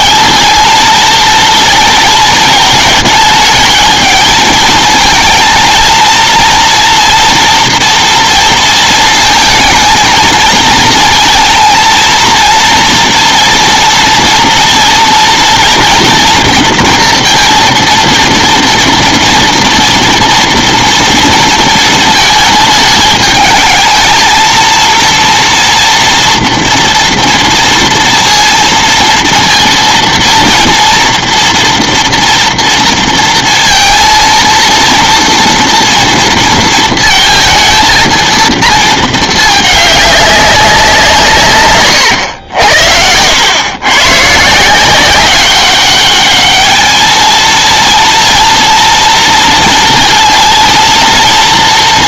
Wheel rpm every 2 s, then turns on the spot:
220, 230, 220, 230, 230, 230, 230, 230, 240, 230, 230, 220, 230, 240, 230, 230, 230, 230, 230, 230, 190, 80, 160, 210, 230, 230.
none